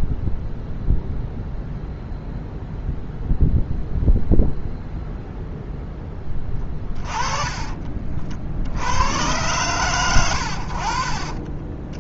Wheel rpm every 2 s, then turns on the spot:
0, 0, 0, 20, 70, 90.
6-8